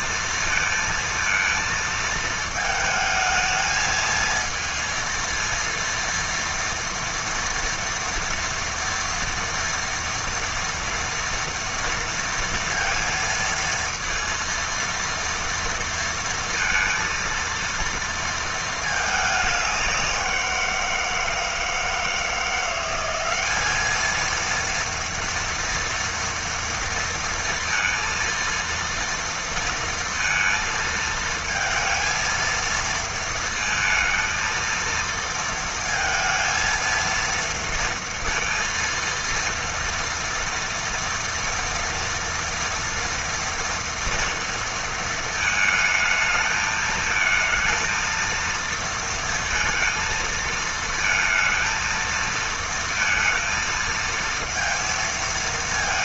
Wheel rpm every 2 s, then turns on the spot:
230, 220, 230, 230, 230, 230, 230, 230, 230, 220, 170, 180, 230, 230, 230, 230, 230, 230, 230, 230, 230, 240, 230, 220, 230, 220, 230, 230.
none